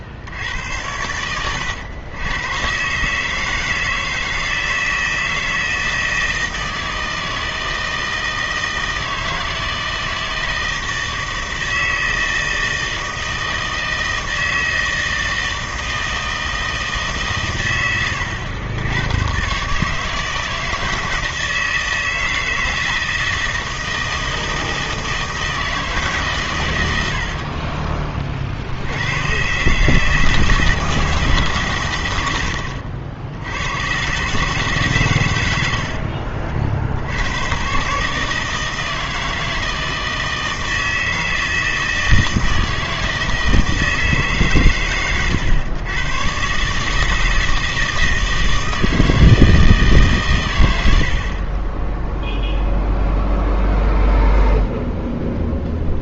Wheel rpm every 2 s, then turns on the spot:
90, 110, 160, 160, 160, 160, 160, 160, 160, 90, 160, 160, 160, 100, 60, 160, 80, 150, 60, 160, 160, 160, 130, 140, 160, 100, 0, 0.
none